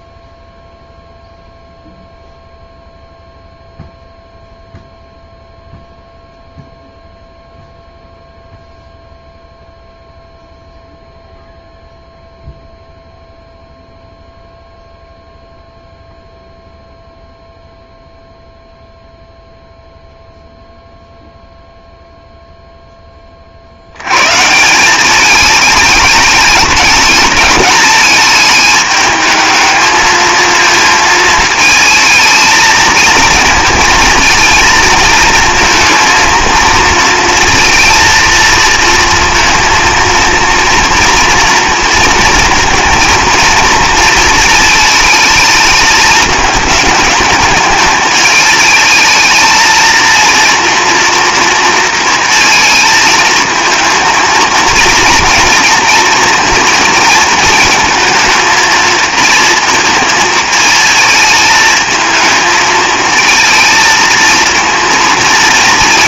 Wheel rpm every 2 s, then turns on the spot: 0, 0, 0, 0, 0, 0, 0, 0, 0, 0, 0, 0, 160, 210, 220, 220, 220, 230, 230, 230, 230, 230, 230, 210, 210, 230, 220, 230, 230, 220, 220, 220, 230.
none